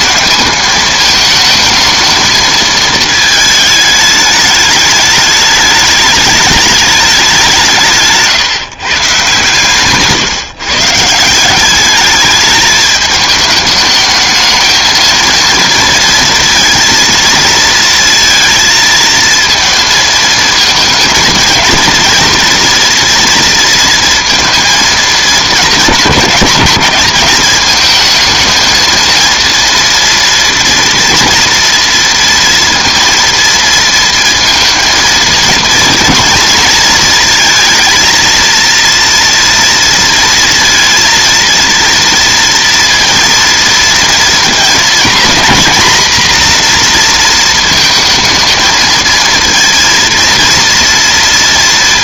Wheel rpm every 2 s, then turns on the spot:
220, 220, 210, 210, 150, 140, 210, 220, 230, 230, 230, 230, 230, 210, 220, 230, 230, 230, 220, 230, 230, 230, 230, 240, 220, 230.
none